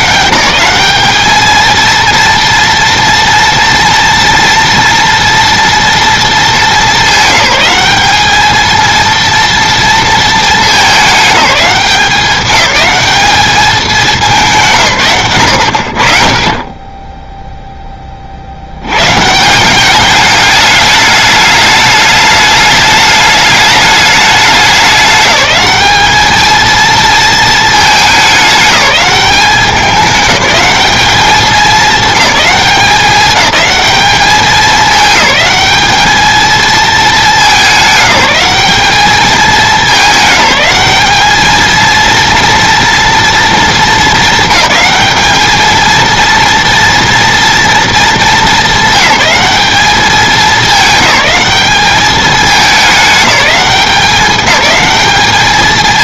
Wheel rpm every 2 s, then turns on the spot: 200, 240, 230, 210, 230, 200, 200, 140, 10, 100, 210, 210, 190, 220, 200, 210, 200, 210, 220, 210, 210, 230, 220, 230, 200, 200, 210, 210.
none